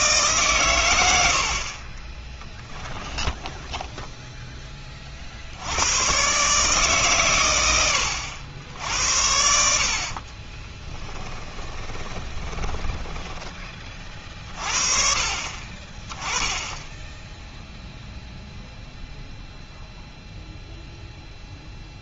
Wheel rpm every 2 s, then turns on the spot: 110, 10, 20, 150, 80, 30, 20, 40, 10, 0, 0.
2-4 10-14